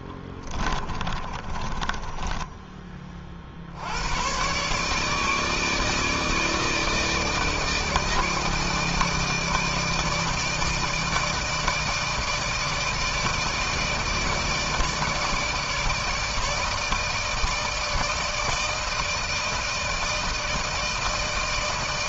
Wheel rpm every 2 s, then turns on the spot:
20, 20, 140, 160, 160, 160, 160, 160, 160, 160, 160.
0-2